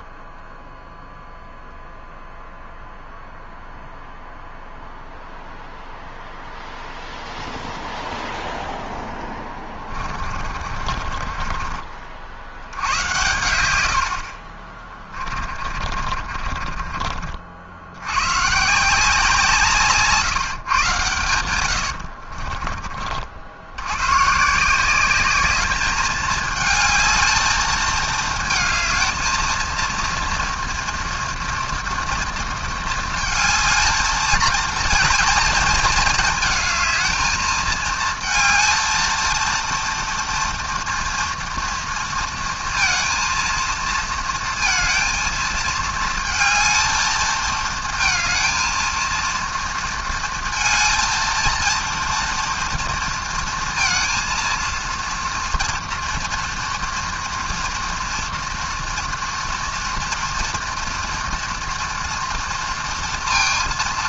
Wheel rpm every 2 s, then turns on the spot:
0, 0, 0, 0, 10, 40, 80, 30, 50, 150, 140, 50, 180, 220, 220, 230, 230, 220, 220, 230, 230, 230, 230, 220, 220, 230, 230, 230, 230, 230, 230, 230.
8-12 14-18 22-24